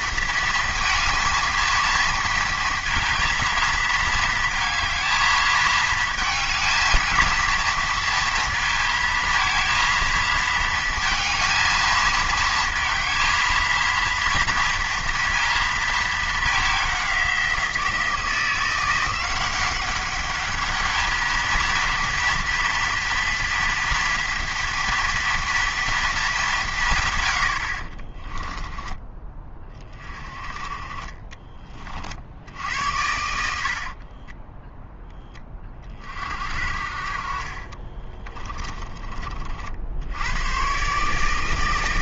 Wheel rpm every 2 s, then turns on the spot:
230, 230, 220, 220, 220, 220, 220, 230, 200, 170, 210, 230, 230, 170, 20, 30, 80, 10, 60, 30, 120.
28-30 34-36 38-40